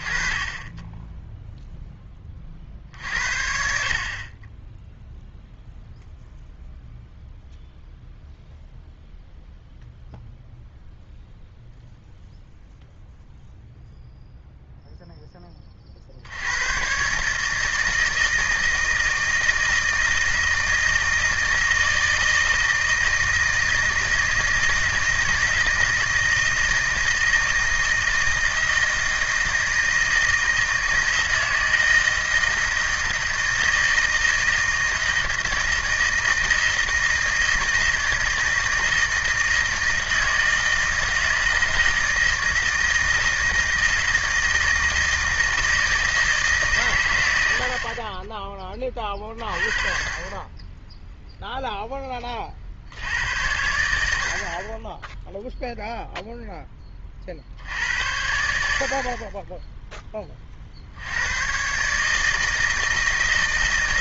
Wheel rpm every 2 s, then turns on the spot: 20, 40, 20, 0, 0, 0, 0, 0, 90, 160, 160, 160, 160, 160, 160, 160, 160, 160, 160, 160, 160, 160, 160, 140, 20, 20, 50, 50, 10, 70, 40, 160.
none